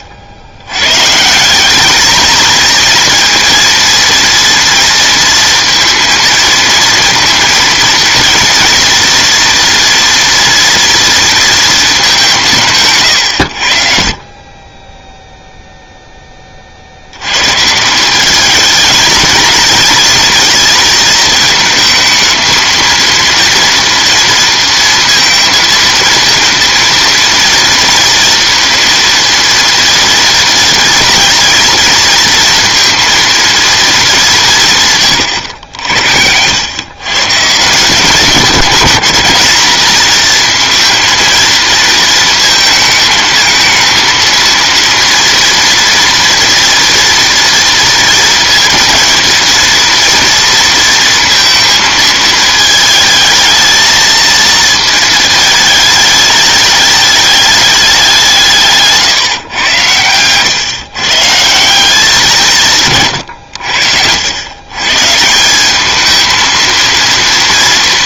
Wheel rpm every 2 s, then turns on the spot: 80, 230, 230, 230, 230, 230, 160, 20, 30, 210, 220, 220, 230, 230, 230, 230, 230, 170, 100, 200, 230, 220, 230, 230, 230, 230, 220, 220, 210, 170, 110, 150, 110, 230.
none